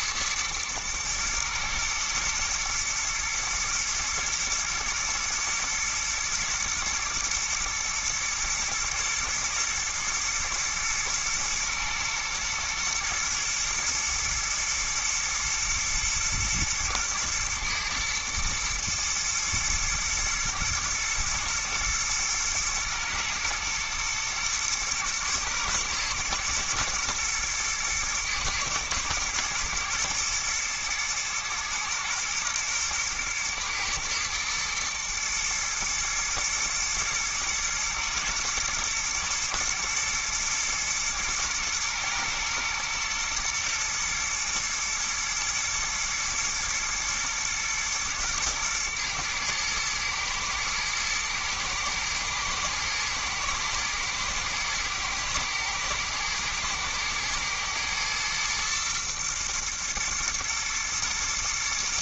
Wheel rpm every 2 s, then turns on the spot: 120, 110, 110, 120, 110, 120, 110, 110, 120, 120, 110, 110, 120, 120, 120, 110, 120, 110, 120, 120, 120, 110, 110, 120, 110, 110, 110, 110, 110, 120, 110.
none